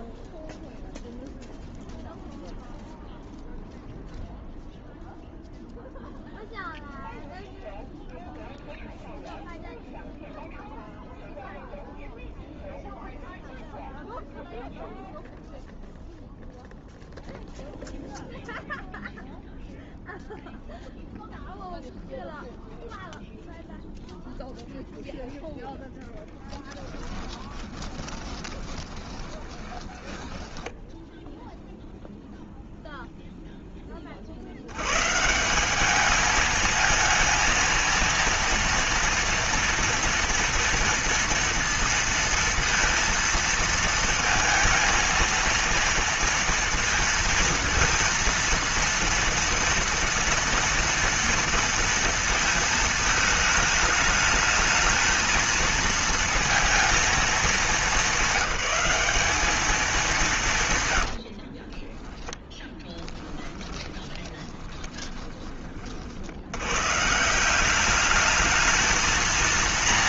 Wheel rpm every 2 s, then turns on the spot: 0, 0, 0, 0, 0, 0, 0, 0, 0, 0, 0, 0, 0, 10, 20, 10, 0, 70, 220, 230, 230, 230, 220, 230, 230, 230, 220, 220, 230, 200, 160, 10, 20, 90, 210.
26-32 62-66